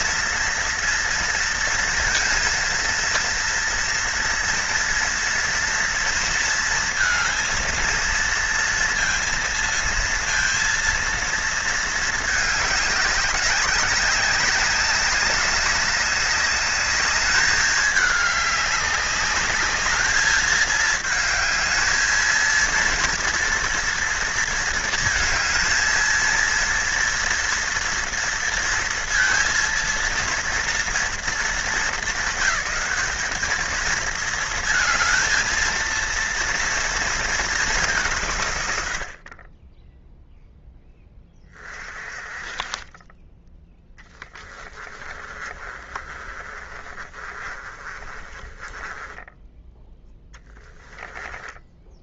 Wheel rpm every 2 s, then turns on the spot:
230, 230, 230, 230, 230, 230, 200, 200, 210, 200, 220, 230, 220, 230, 230, 220, 210, 230, 220, 50, 20, 20, 30, 30, 20, 10.
44-52